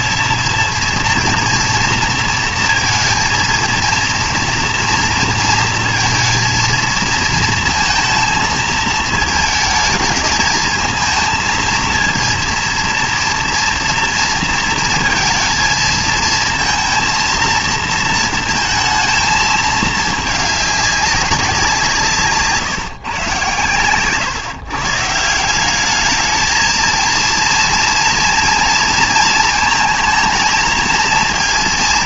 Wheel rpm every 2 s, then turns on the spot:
230, 230, 230, 230, 220, 220, 230, 230, 230, 230, 210, 150, 140, 220, 230, 220.
none